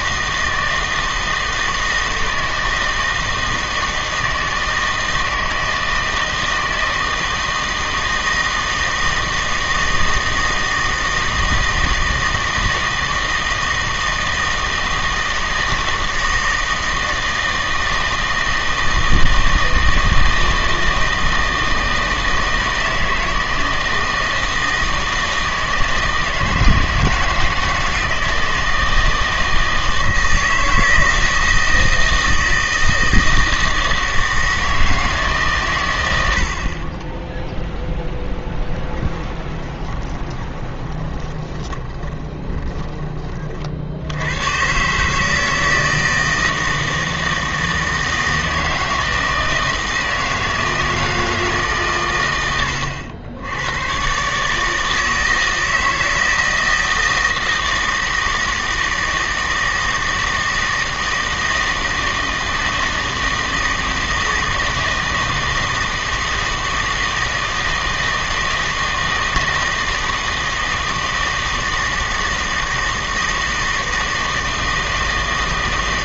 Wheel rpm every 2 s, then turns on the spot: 160, 160, 160, 160, 160, 160, 160, 160, 160, 160, 160, 160, 160, 160, 160, 160, 160, 160, 50, 10, 20, 20, 120, 160, 160, 160, 100, 150, 160, 160, 160, 160, 160, 160, 160, 160, 160, 160.
38-44